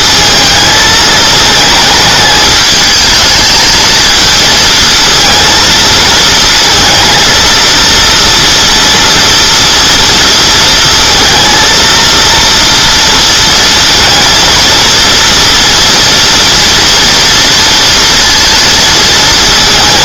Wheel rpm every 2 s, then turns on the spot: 220, 210, 230, 220, 230, 230, 230, 230, 240, 230.
none